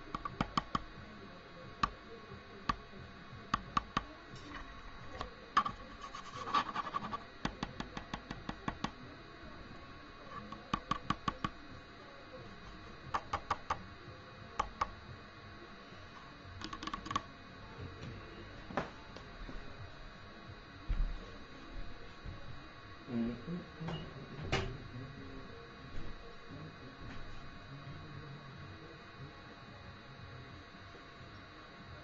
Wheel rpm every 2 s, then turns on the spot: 0, 0, 0, 0, 0, 0, 0, 0, 0, 0, 0, 0, 0, 0, 0, 0.
none